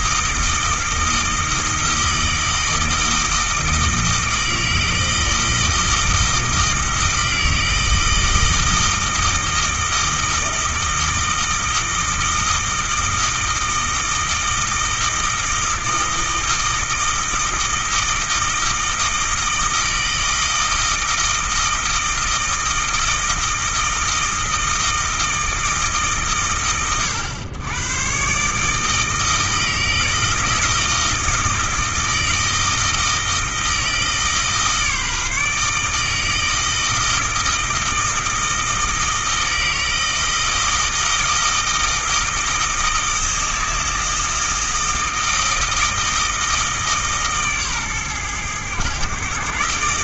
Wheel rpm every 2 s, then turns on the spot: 160, 160, 160, 160, 160, 160, 160, 160, 160, 160, 160, 160, 160, 110, 160, 160, 160, 150, 160, 160, 160, 160, 160, 150, 120.
none